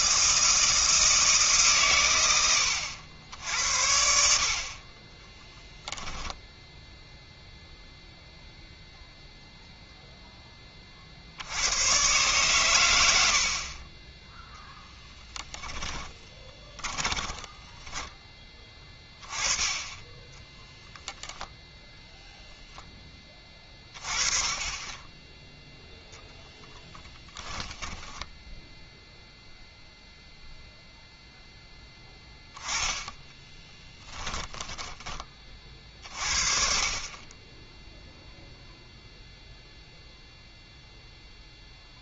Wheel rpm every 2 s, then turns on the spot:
160, 90, 40, 0, 0, 20, 110, 0, 20, 20, 0, 0, 20, 10, 0, 0, 10, 20, 60, 0, 0.
16-18 26-28 34-36